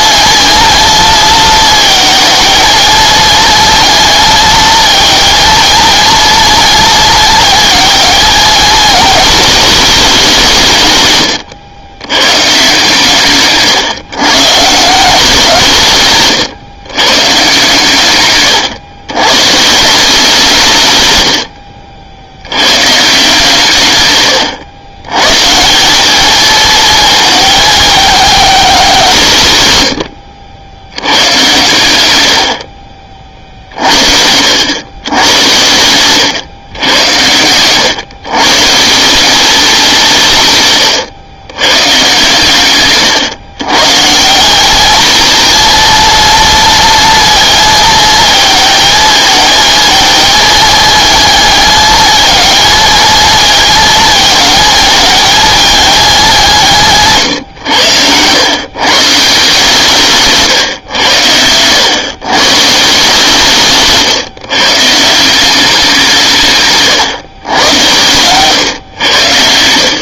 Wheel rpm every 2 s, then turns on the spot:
220, 230, 220, 230, 220, 160, 140, 150, 130, 120, 150, 110, 110, 220, 200, 80, 50, 90, 110, 150, 140, 140, 200, 230, 220, 220, 220, 220, 190, 120, 140, 140, 150, 130, 120.
none